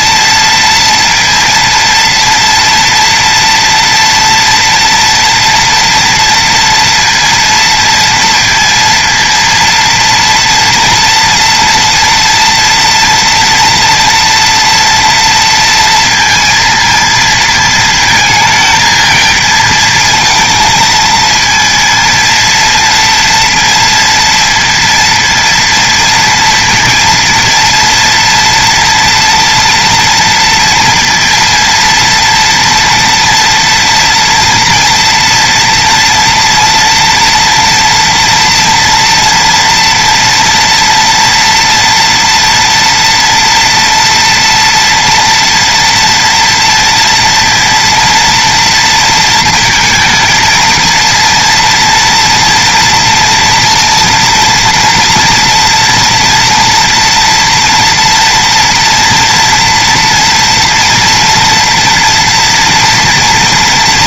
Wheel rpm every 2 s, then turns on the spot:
230, 230, 230, 230, 230, 230, 230, 230, 230, 220, 230, 230, 230, 230, 230, 230, 230, 230, 240, 230, 240, 230, 240, 230, 230, 230, 230, 230, 230, 230, 230, 230.
none